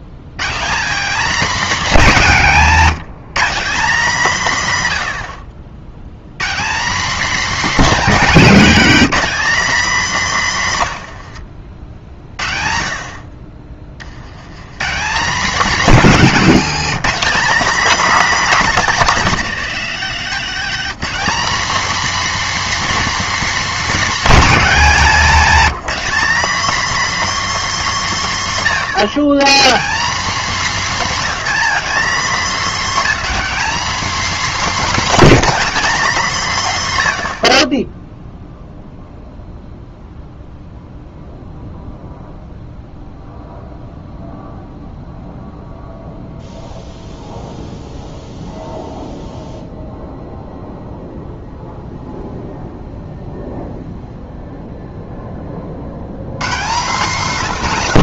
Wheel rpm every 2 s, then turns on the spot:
120, 190, 140, 190, 230, 160, 50, 130, 200, 240, 230, 280, 220, 250, 150, 240, 220, 250, 140, 0, 0, 0, 0, 0, 0, 0, 0, 0, 140.
2-4 10-12